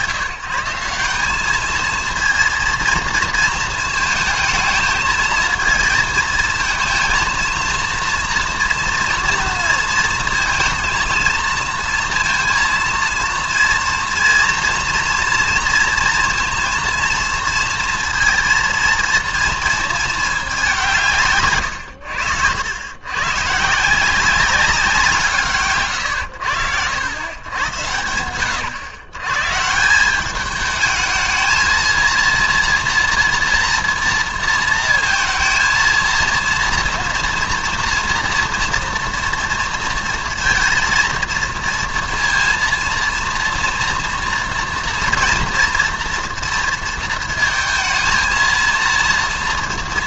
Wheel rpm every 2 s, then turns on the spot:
160, 230, 220, 230, 230, 230, 230, 230, 230, 230, 180, 90, 180, 80, 120, 210, 230, 230, 230, 230, 230, 230, 230, 230, 230.
none